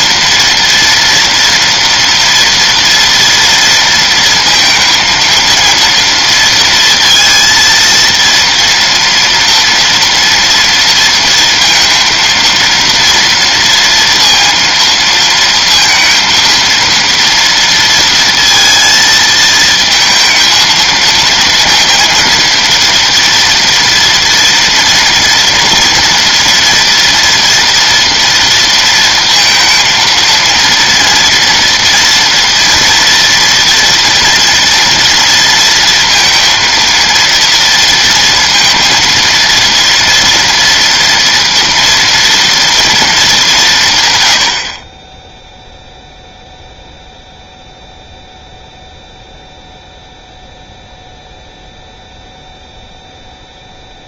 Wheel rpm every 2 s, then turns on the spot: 230, 230, 230, 230, 230, 230, 230, 230, 230, 230, 220, 230, 230, 240, 230, 230, 230, 230, 230, 230, 230, 220, 30, 0, 0, 0, 0.
none